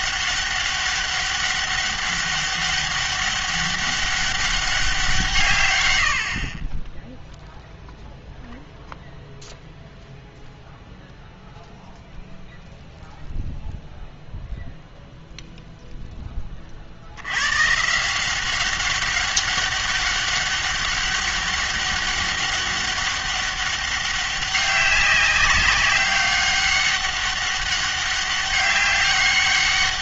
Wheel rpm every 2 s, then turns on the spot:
200, 200, 190, 30, 0, 0, 0, 0, 40, 190, 200, 200, 190, 200, 200.
none